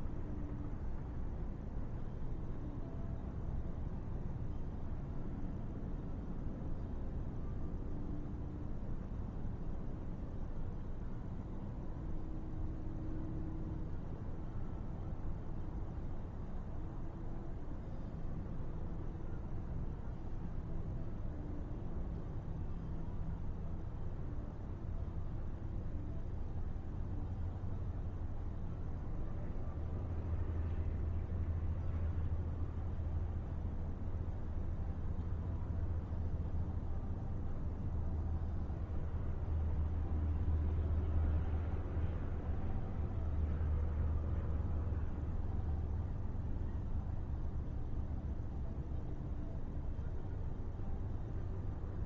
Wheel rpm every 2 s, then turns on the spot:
0, 0, 0, 0, 0, 0, 0, 0, 0, 0, 0, 0, 0, 0, 0, 0, 0, 0, 0, 0, 0, 0, 0, 0, 0, 0.
none